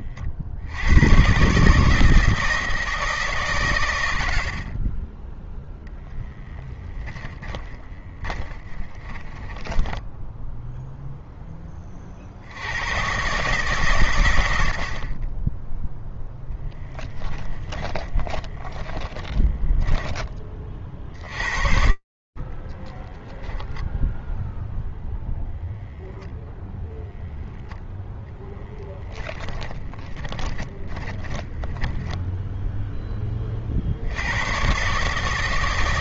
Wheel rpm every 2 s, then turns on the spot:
80, 160, 40, 20, 20, 0, 120, 30, 10, 30, 60, 0, 0, 0, 10, 20, 10, 140.
4-10 16-20 28-32